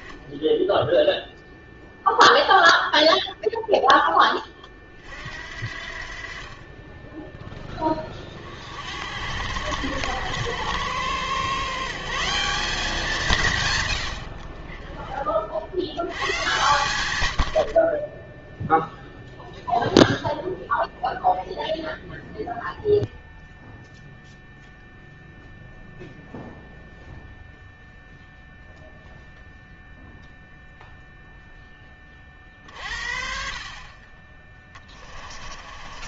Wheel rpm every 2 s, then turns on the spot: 0, 0, 30, 40, 60, 100, 190, 40, 120, 0, 0, 0, 0, 0, 0, 0, 50, 20.
34-36